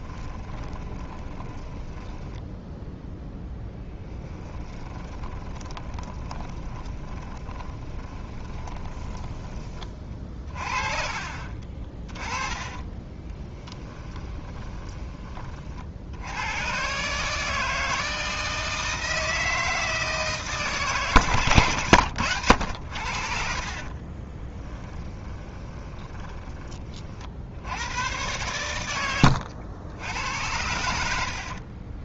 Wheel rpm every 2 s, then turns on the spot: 10, 0, 20, 30, 20, 30, 30, 20, 120, 160, 140, 90, 10, 30, 100, 80.
0-2 4-10 12-16 24-26 30-32